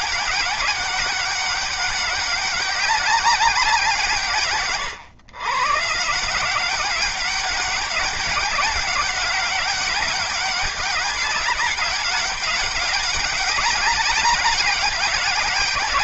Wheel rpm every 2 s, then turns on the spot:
200, 200, 130, 190, 190, 200, 200, 200.
none